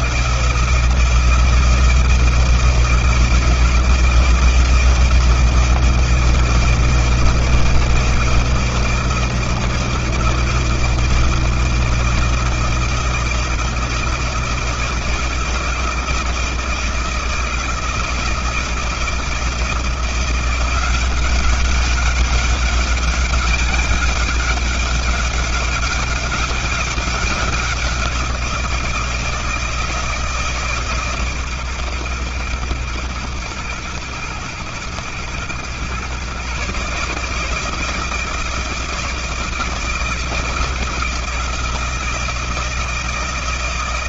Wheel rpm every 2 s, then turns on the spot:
170, 170, 160, 160, 160, 170, 160, 160, 160, 170, 200, 200, 200, 180, 160, 130, 110, 120, 160, 160, 160, 160.
none